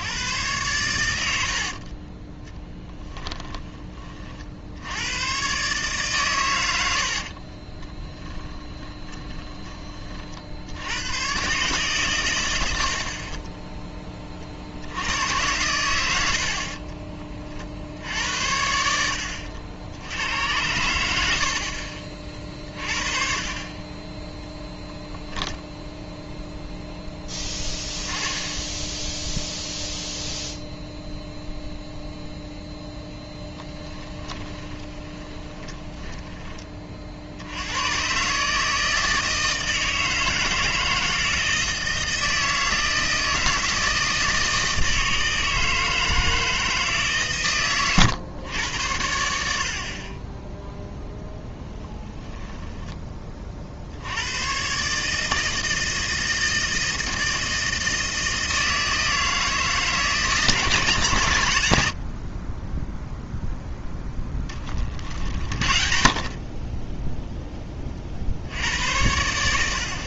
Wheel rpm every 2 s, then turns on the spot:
110, 10, 80, 100, 10, 80, 70, 70, 50, 80, 100, 40, 10, 0, 10, 0, 0, 20, 30, 150, 160, 160, 160, 160, 90, 10, 10, 130, 160, 160, 150, 20, 30, 20, 80.
2-4 6-10 16-18 34-36